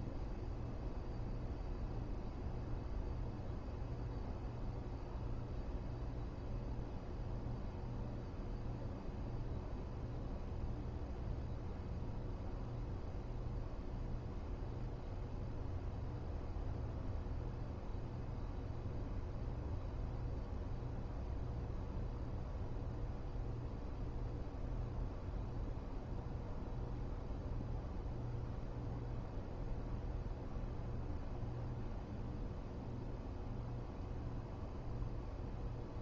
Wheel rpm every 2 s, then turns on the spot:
0, 0, 0, 0, 0, 0, 0, 0, 0, 0, 0, 0, 0, 0, 0, 0, 0, 0.
none